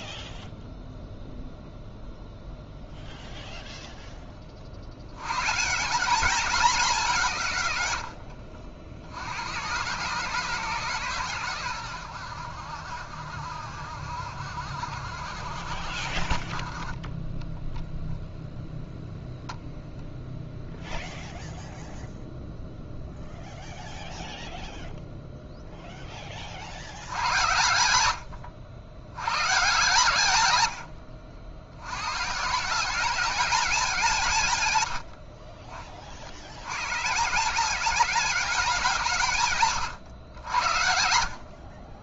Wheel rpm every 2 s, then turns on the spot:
0, 0, 90, 180, 80, 120, 60, 60, 20, 0, 0, 0, 0, 80, 100, 90, 190, 80, 130, 160, 70.
34-36